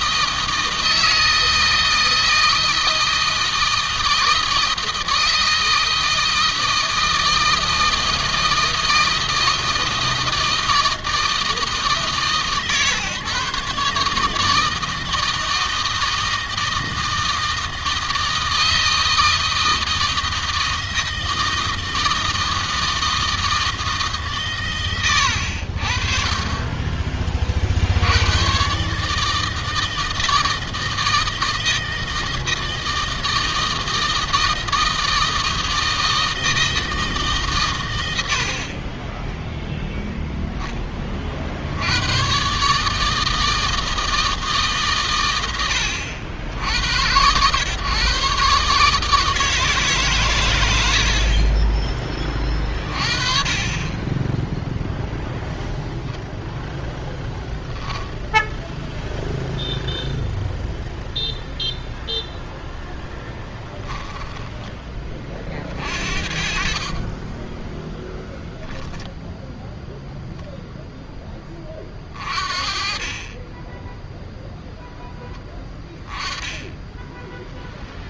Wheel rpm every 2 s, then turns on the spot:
160, 160, 160, 160, 160, 160, 130, 160, 160, 160, 160, 160, 130, 20, 130, 160, 160, 160, 160, 50, 20, 140, 130, 80, 140, 90, 30, 0, 0, 0, 0, 0, 20, 30, 0, 0, 40, 0, 10.
none